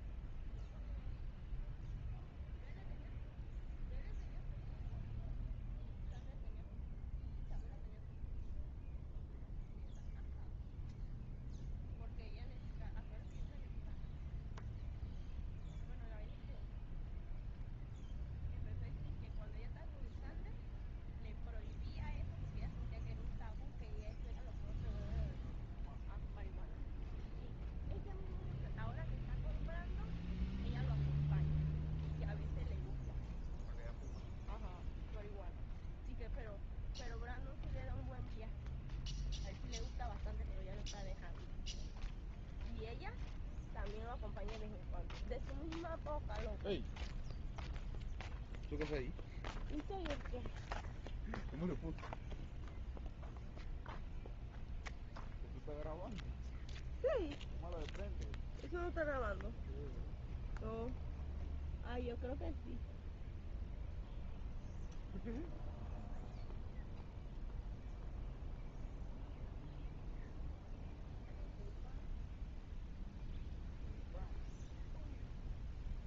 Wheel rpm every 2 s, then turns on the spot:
0, 0, 0, 0, 0, 0, 0, 0, 0, 0, 0, 0, 0, 0, 0, 0, 0, 0, 0, 0, 0, 0, 0, 0, 0, 0, 0, 0, 0, 0, 0, 0, 0, 0, 0, 0, 0, 0.
none